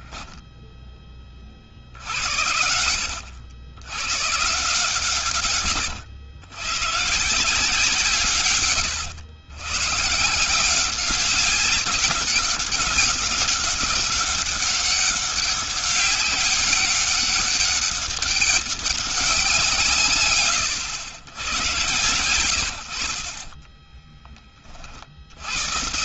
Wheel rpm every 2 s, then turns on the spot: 10, 70, 140, 120, 110, 180, 190, 200, 200, 200, 110, 80, 60.
none